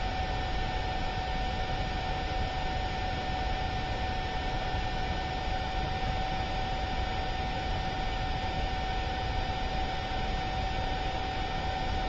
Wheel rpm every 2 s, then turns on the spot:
0, 0, 0, 0, 0, 0.
none